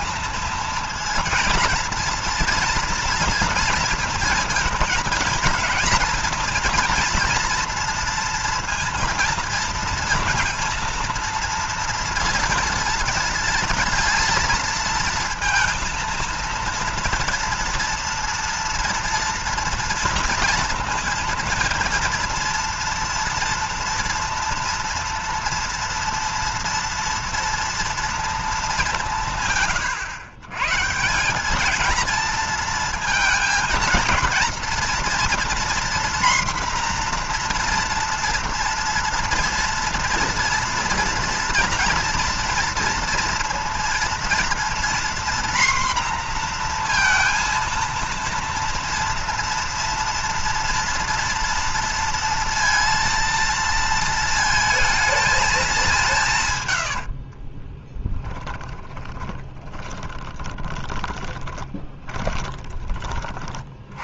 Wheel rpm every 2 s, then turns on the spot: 230, 230, 230, 230, 230, 230, 230, 230, 230, 230, 230, 230, 230, 230, 200, 150, 230, 230, 250, 240, 240, 230, 240, 240, 230, 230, 230, 220, 110, 20, 20, 30.
56-62